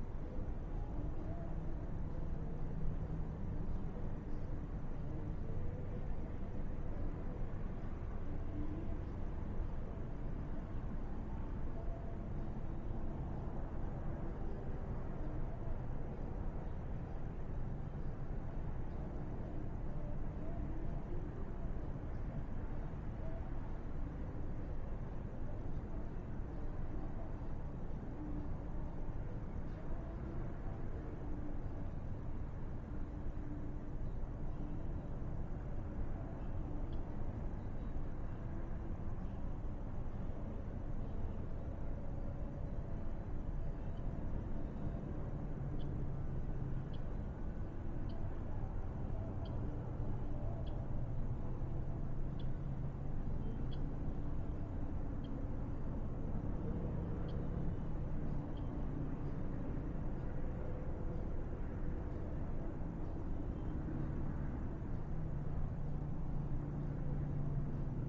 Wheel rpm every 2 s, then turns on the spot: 0, 0, 0, 0, 0, 0, 0, 0, 0, 0, 0, 0, 0, 0, 0, 0, 0, 0, 0, 0, 0, 0, 0, 0, 0, 0, 0, 0, 0, 0, 0, 0, 0, 0.
none